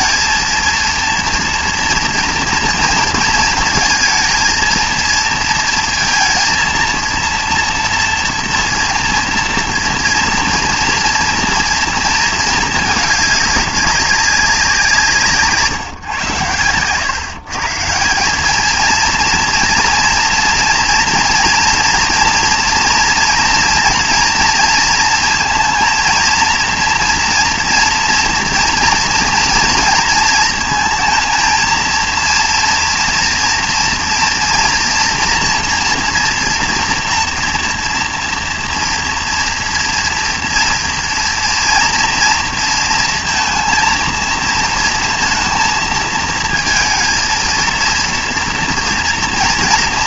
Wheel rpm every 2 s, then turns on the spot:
230, 230, 220, 230, 230, 230, 220, 190, 110, 210, 230, 240, 230, 230, 230, 230, 230, 230, 230, 230, 230, 230, 230, 230, 230.
none